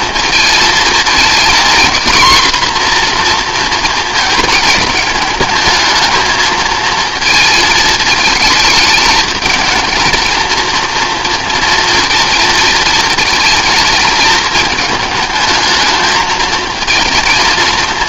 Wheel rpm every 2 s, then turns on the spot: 220, 250, 220, 230, 220, 230, 220, 220, 220.
none